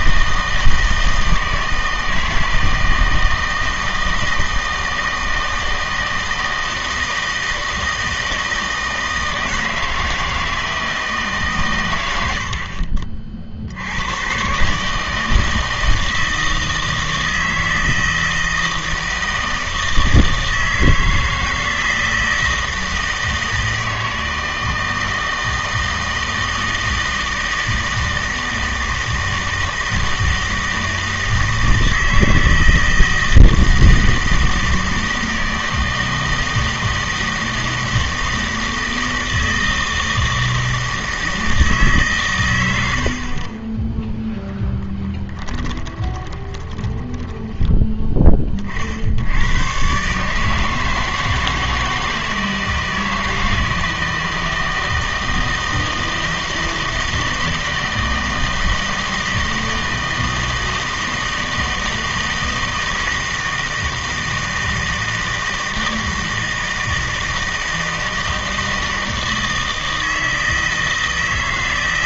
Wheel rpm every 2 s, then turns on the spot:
160, 160, 160, 160, 160, 160, 50, 140, 160, 160, 160, 160, 160, 160, 160, 160, 160, 160, 160, 160, 160, 90, 10, 20, 30, 150, 160, 160, 160, 160, 160, 160, 160, 160, 160, 160.
46-48